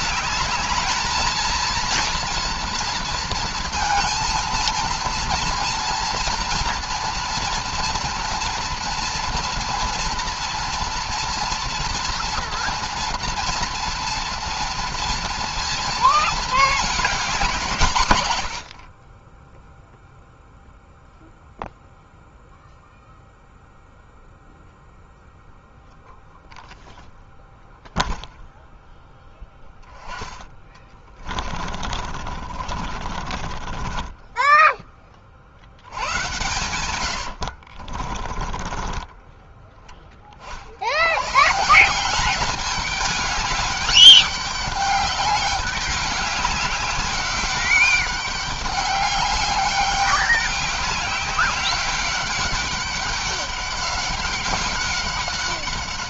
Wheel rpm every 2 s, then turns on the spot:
210, 230, 230, 230, 230, 240, 240, 230, 220, 100, 0, 0, 0, 0, 0, 10, 40, 20, 100, 20, 50, 190, 200, 190, 200, 200, 200, 200.
30-36 38-40